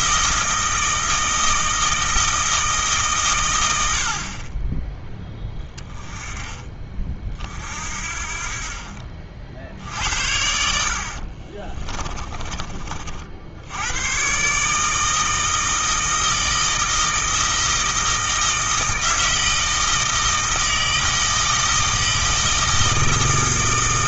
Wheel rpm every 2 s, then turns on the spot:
160, 150, 20, 30, 50, 60, 40, 150, 160, 160, 160, 160.
10-12